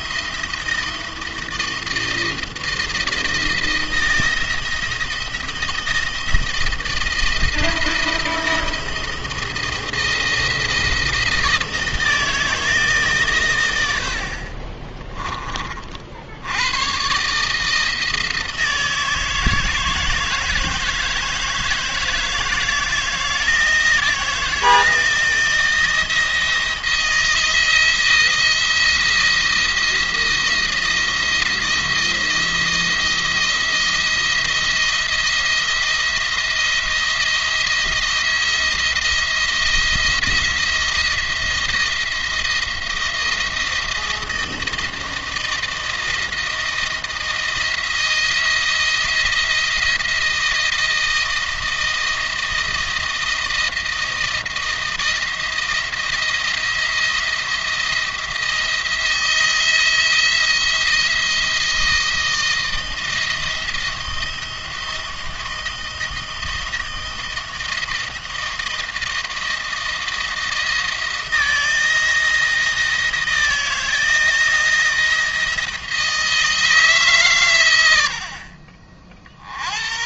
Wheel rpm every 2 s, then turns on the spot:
170, 170, 170, 170, 170, 170, 160, 40, 90, 160, 160, 170, 170, 170, 170, 170, 170, 170, 170, 170, 170, 170, 160, 170, 170, 170, 160, 160, 170, 170, 170, 160, 170, 170, 170, 160, 160, 170, 160, 50.
14-16